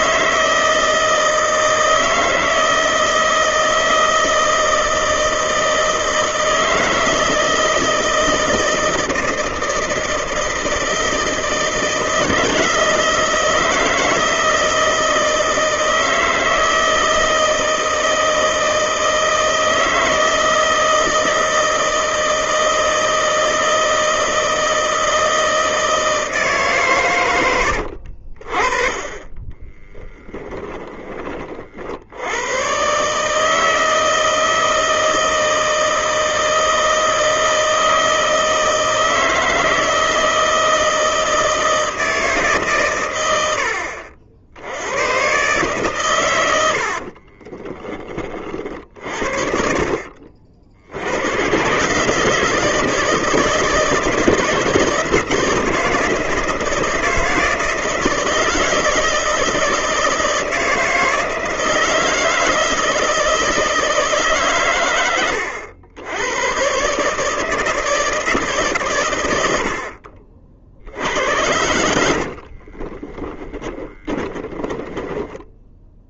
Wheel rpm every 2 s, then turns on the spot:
160, 160, 160, 160, 160, 160, 160, 160, 160, 160, 160, 160, 160, 140, 30, 20, 140, 160, 160, 160, 160, 120, 100, 60, 50, 90, 160, 160, 160, 160, 160, 160, 110, 140, 110, 70, 20, 20.
72-76